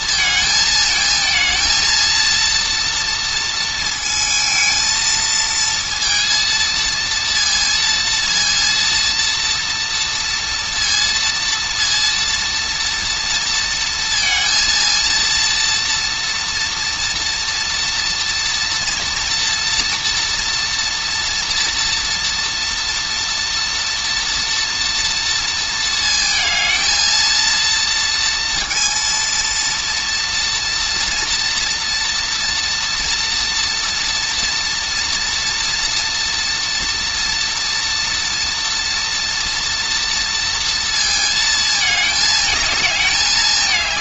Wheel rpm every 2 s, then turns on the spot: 220, 230, 230, 230, 230, 230, 230, 230, 240, 230, 230, 230, 240, 220, 230, 230, 240, 230, 230, 240, 230, 220.
none